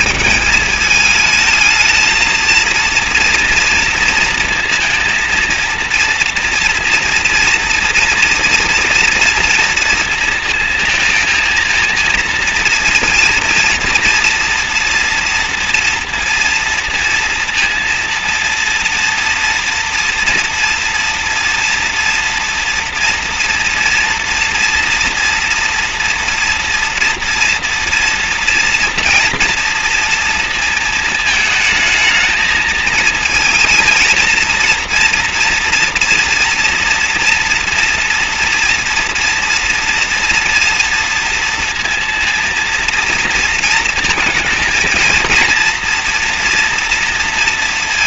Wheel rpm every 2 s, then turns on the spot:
220, 230, 230, 230, 240, 230, 230, 230, 230, 230, 230, 230, 230, 240, 230, 220, 220, 230, 230, 230, 230, 230, 230, 230.
none